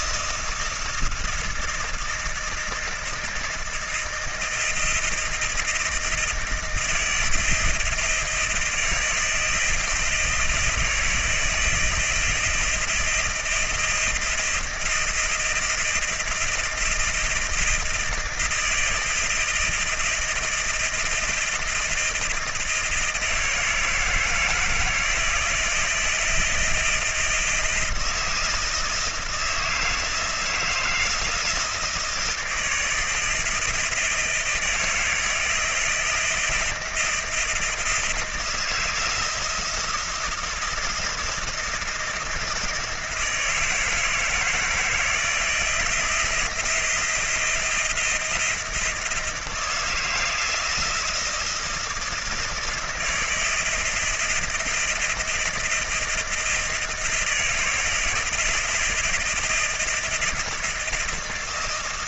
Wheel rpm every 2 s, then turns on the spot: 160, 160, 160, 160, 160, 160, 160, 160, 170, 160, 170, 160, 160, 160, 160, 160, 160, 160, 170, 170, 170, 170, 160, 170, 170, 170, 160, 160, 160, 160, 160.
none